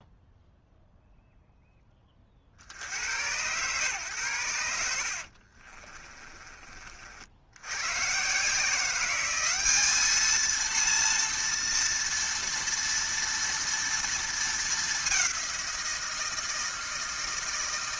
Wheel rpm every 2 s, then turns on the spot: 0, 70, 90, 30, 170, 230, 230, 220, 160.
none